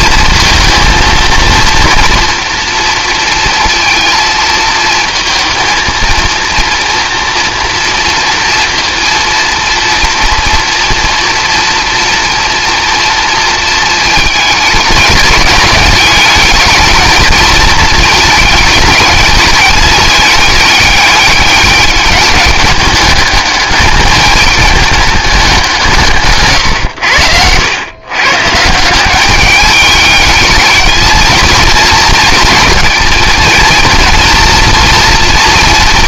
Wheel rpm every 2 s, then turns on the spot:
230, 230, 220, 230, 230, 230, 230, 210, 220, 210, 210, 200, 210, 110, 170, 220, 230, 230.
26-28